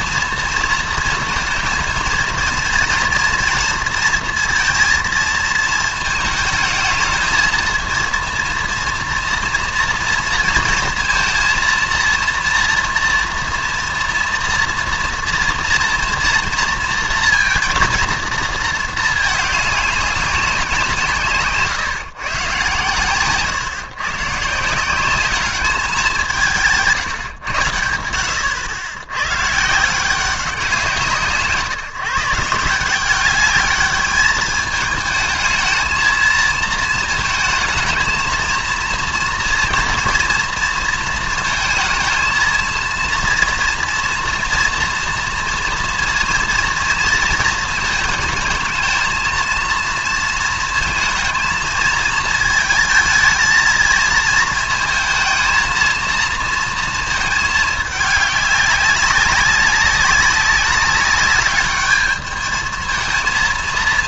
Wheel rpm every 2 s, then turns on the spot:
230, 230, 230, 220, 230, 230, 240, 230, 230, 220, 170, 130, 160, 160, 100, 180, 170, 210, 230, 230, 230, 230, 230, 230, 220, 230, 220, 220, 230, 200, 200, 220.
none